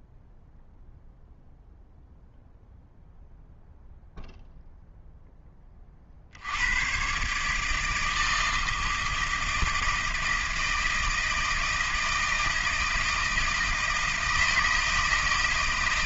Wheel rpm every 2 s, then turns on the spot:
0, 0, 0, 110, 160, 160, 160, 160.
none